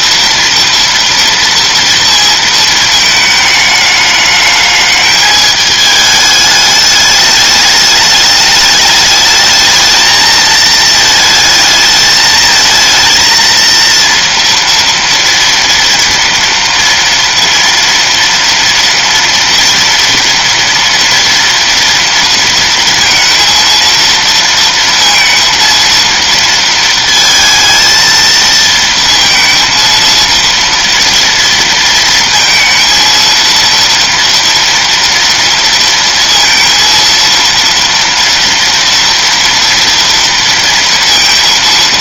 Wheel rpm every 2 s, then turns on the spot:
230, 230, 210, 210, 210, 220, 220, 230, 230, 230, 230, 230, 230, 230, 230, 230, 230, 230, 230, 230, 230.
none